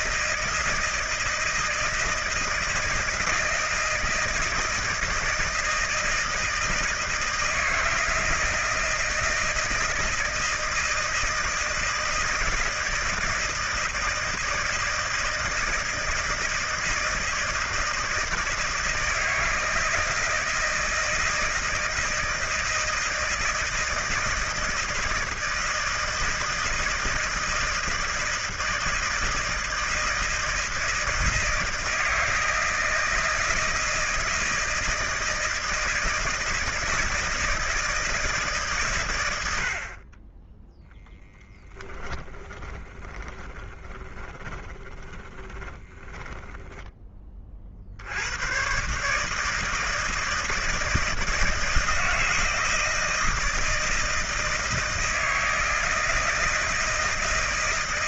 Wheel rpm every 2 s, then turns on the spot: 160, 160, 160, 160, 160, 160, 160, 160, 160, 160, 160, 160, 160, 160, 160, 160, 160, 160, 160, 130, 10, 20, 20, 10, 130, 160, 160, 160, 160.
42-46